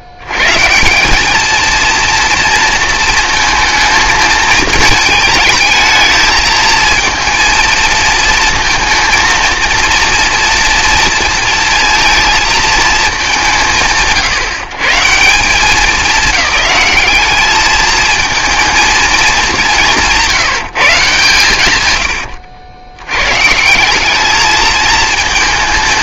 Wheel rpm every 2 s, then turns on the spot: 110, 230, 220, 220, 220, 230, 220, 90, 210, 230, 180, 80, 220.
none